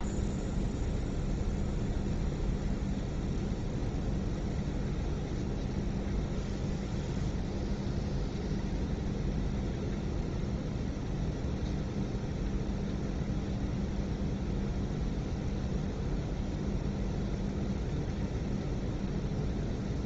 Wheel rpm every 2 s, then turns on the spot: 0, 0, 0, 0, 0, 0, 0, 0, 0, 0.
none